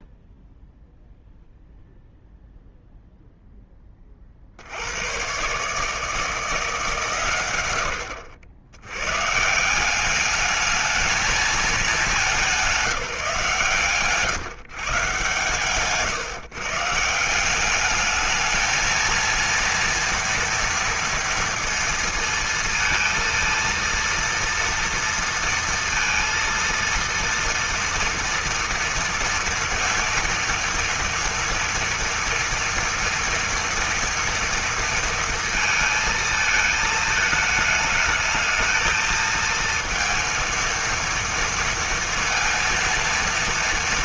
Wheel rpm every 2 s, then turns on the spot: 0, 0, 90, 150, 110, 220, 170, 140, 160, 230, 230, 230, 230, 230, 230, 230, 230, 230, 220, 220, 230, 230.
none